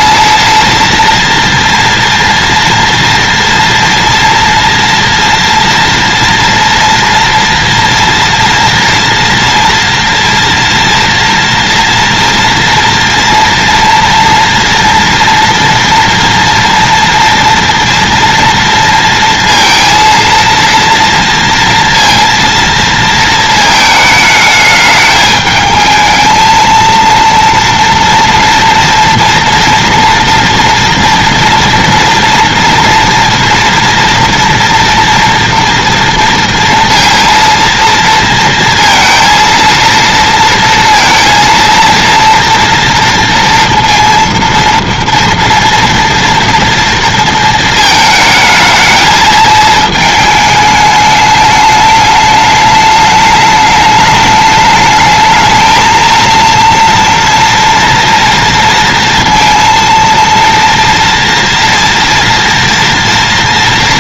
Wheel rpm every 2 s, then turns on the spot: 230, 230, 230, 240, 230, 230, 230, 230, 230, 230, 230, 230, 210, 230, 230, 230, 230, 230, 230, 230, 230, 230, 230, 230, 220, 210, 210, 210, 230, 230, 230, 230.
none